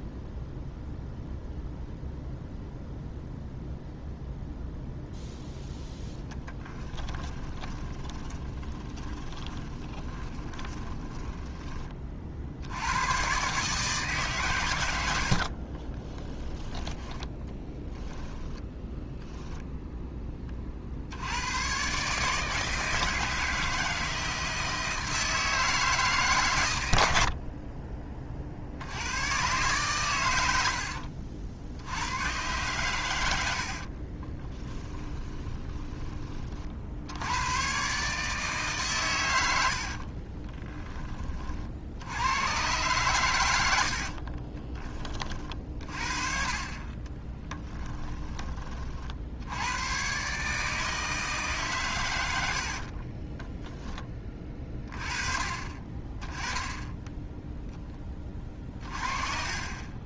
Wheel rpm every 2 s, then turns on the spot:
0, 0, 0, 10, 20, 20, 80, 100, 10, 10, 50, 160, 160, 90, 80, 80, 120, 20, 70, 140, 20, 110, 30, 30, 40, 160, 50, 30, 10, 40.
6-12 16-20 30-32 34-36 52-54